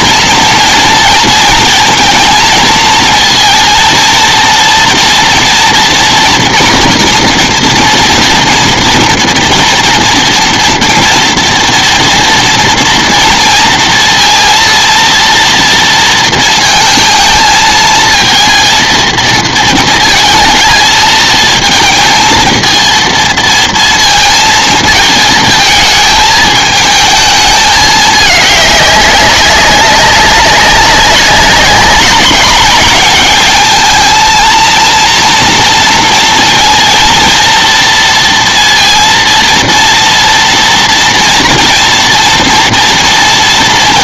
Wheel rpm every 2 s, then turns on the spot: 230, 220, 230, 230, 230, 230, 230, 230, 230, 230, 230, 220, 230, 220, 210, 190, 190, 220, 230, 230, 240, 230.
none